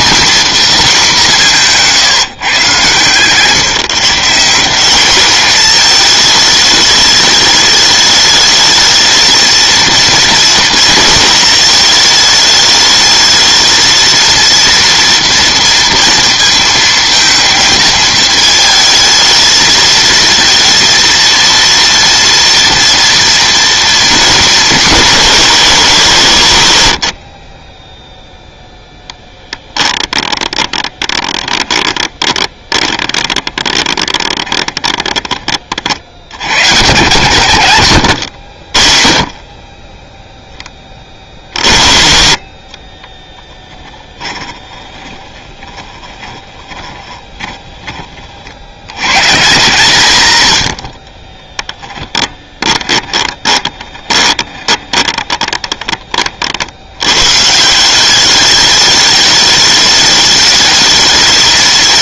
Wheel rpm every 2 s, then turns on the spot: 230, 130, 190, 210, 210, 220, 210, 230, 230, 220, 230, 230, 210, 90, 0, 20, 20, 20, 110, 60, 20, 30, 20, 20, 70, 80, 20, 20, 70, 200, 210.
30-36 42-48 52-56